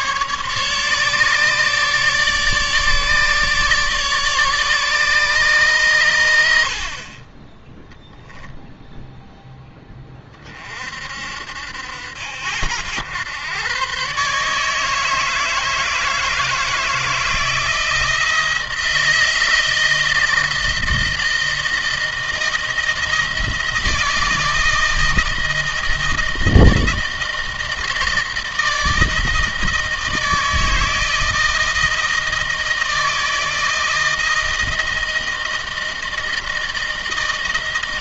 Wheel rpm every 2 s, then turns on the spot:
150, 150, 150, 60, 0, 40, 90, 150, 160, 160, 160, 160, 160, 160, 160, 160, 160, 160, 160.
none